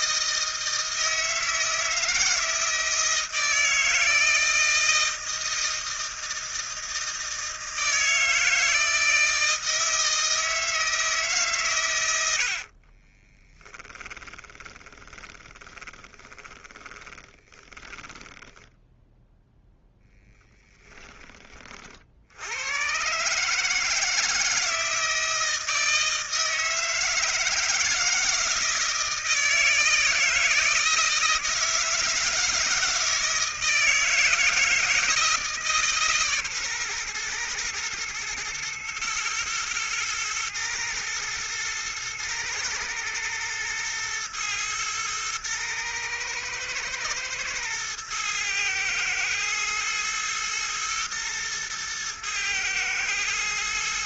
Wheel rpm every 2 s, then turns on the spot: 160, 160, 160, 160, 160, 160, 50, 10, 20, 10, 20, 120, 160, 160, 160, 160, 160, 160, 130, 120, 120, 110, 120, 110, 110, 110, 110.
12-20